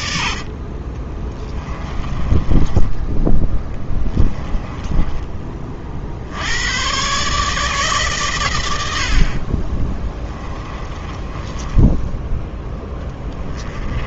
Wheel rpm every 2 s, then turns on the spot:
30, 20, 20, 120, 80, 20, 10.
0-6 10-14